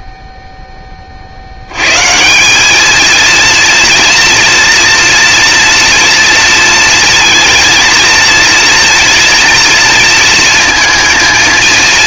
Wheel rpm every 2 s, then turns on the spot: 20, 200, 230, 230, 240, 230.
none